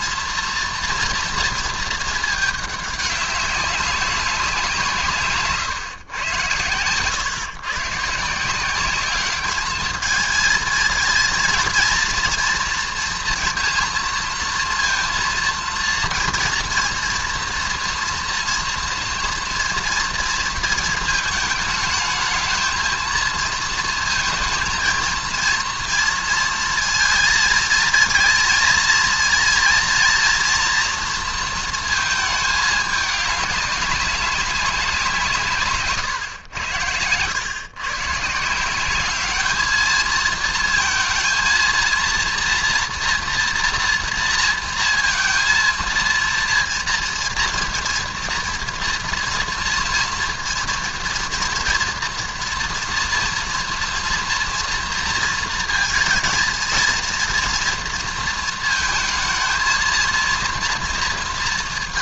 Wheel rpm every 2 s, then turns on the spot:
230, 210, 160, 110, 190, 220, 240, 230, 230, 240, 230, 230, 230, 230, 230, 240, 210, 190, 100, 190, 230, 240, 230, 230, 230, 230, 230, 230, 220, 220, 230.
6-8